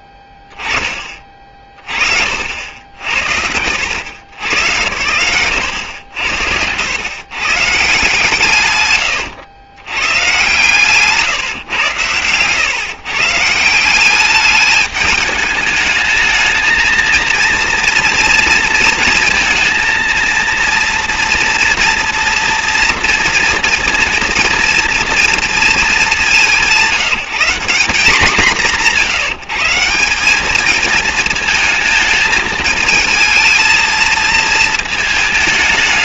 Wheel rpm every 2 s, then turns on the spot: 10, 70, 90, 90, 130, 140, 140, 210, 230, 230, 230, 230, 230, 180, 170, 220, 220, 220.
none